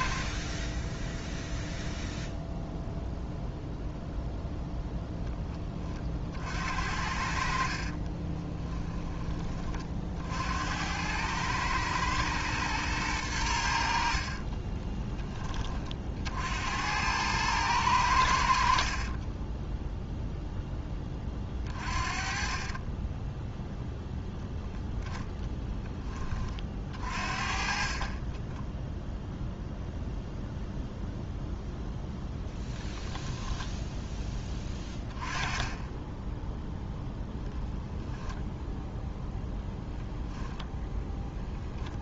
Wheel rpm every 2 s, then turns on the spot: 10, 0, 0, 60, 20, 90, 110, 20, 90, 50, 10, 20, 0, 40, 0, 0, 10, 20, 0, 0, 0.
14-16 22-24 34-36